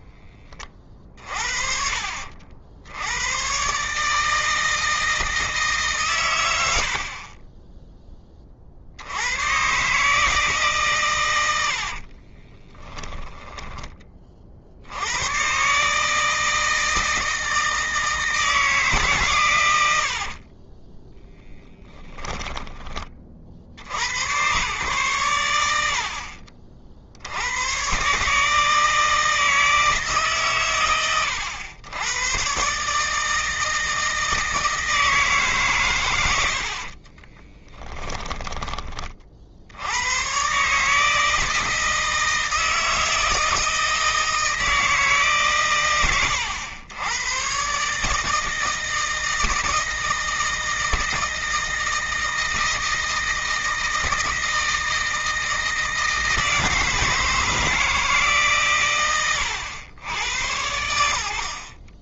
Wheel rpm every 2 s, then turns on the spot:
40, 100, 160, 50, 60, 140, 20, 90, 160, 140, 10, 40, 110, 60, 160, 130, 140, 160, 50, 30, 150, 160, 160, 100, 160, 160, 160, 160, 160, 130, 100.
12-14 36-38